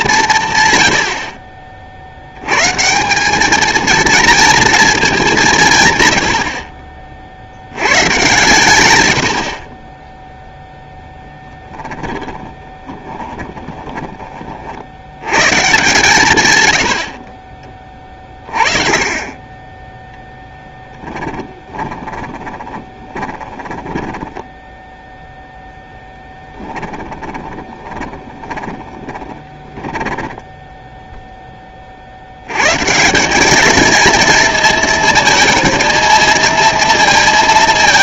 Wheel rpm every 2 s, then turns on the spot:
110, 140, 230, 50, 120, 0, 20, 50, 100, 30, 10, 20, 0, 20, 20, 0, 130, 230, 230.
12-14 20-24 26-30